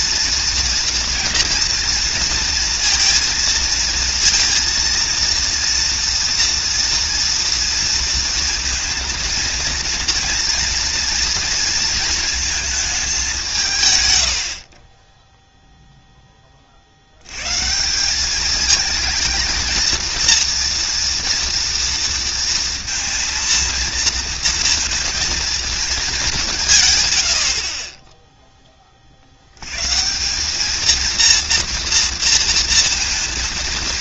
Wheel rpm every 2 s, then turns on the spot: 240, 230, 230, 230, 230, 230, 220, 70, 40, 210, 230, 230, 230, 180, 10, 200, 230.
none